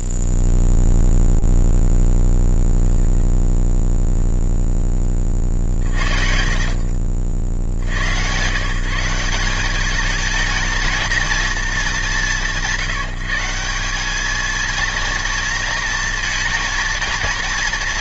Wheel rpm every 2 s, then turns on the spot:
0, 0, 0, 50, 90, 210, 210, 200, 230.
6-8